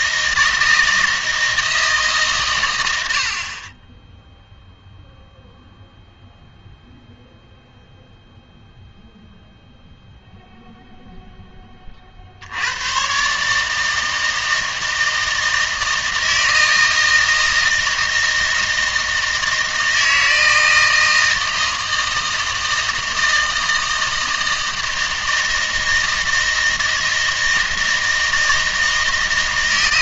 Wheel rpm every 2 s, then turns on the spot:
160, 100, 0, 0, 0, 0, 100, 160, 160, 160, 160, 160, 160, 160, 160.
none